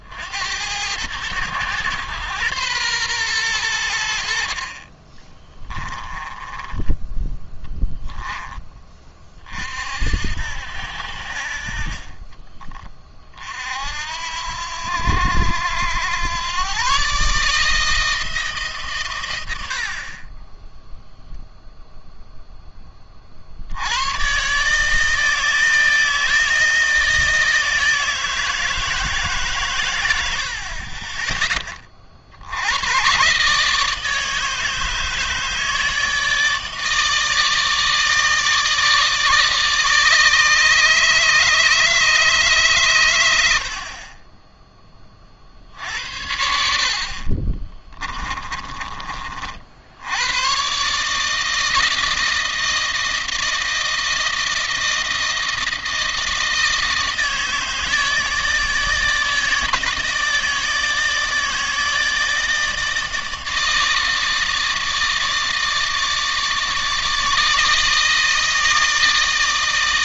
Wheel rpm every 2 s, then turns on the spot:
90, 120, 50, 10, 20, 70, 30, 80, 120, 150, 20, 10, 130, 160, 160, 60, 80, 150, 160, 160, 150, 140, 20, 60, 20, 120, 160, 160, 160, 160, 160, 160, 160, 150, 160.
6-8 20-22 46-48